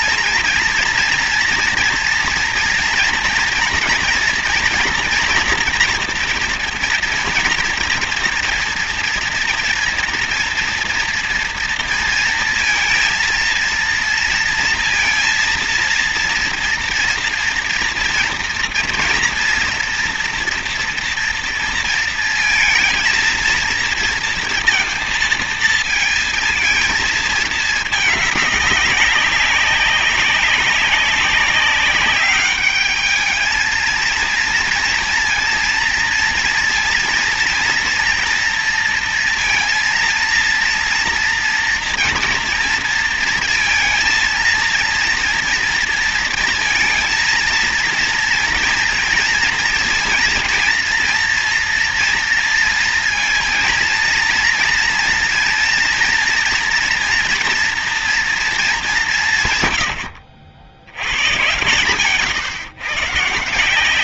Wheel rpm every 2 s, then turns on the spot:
230, 230, 240, 240, 230, 230, 230, 230, 240, 230, 240, 220, 230, 220, 200, 190, 210, 230, 230, 230, 230, 230, 230, 230, 240, 230, 230, 230, 240, 180, 90, 130.
none